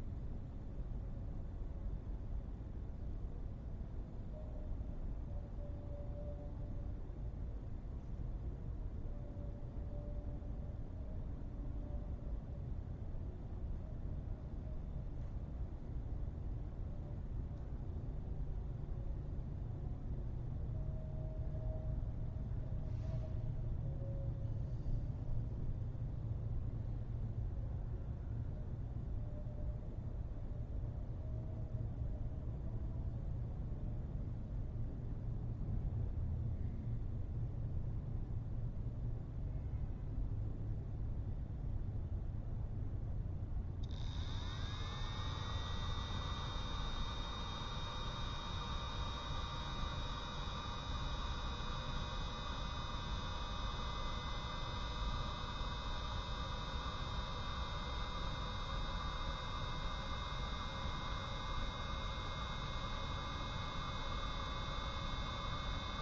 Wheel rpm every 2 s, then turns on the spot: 0, 0, 0, 0, 0, 0, 0, 0, 0, 0, 0, 0, 0, 0, 0, 0, 0, 0, 0, 0, 0, 0, 0, 0, 0, 0, 0, 0, 0, 0, 0, 0, 0.
none